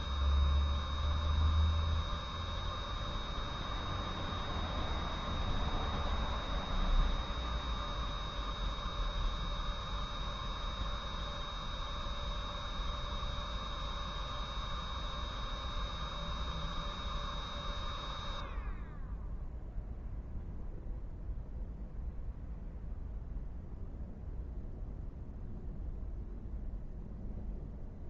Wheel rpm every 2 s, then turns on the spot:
0, 0, 0, 0, 0, 0, 0, 0, 0, 0, 0, 0, 0, 0.
none